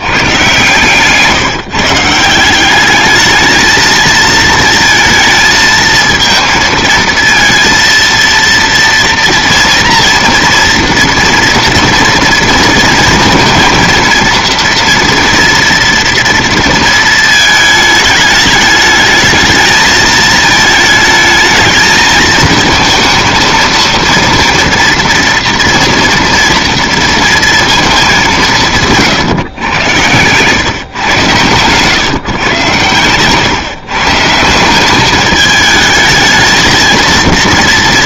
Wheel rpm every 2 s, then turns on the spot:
130, 190, 230, 220, 230, 240, 230, 230, 230, 210, 220, 220, 230, 230, 170, 130, 130, 170, 220.
28-30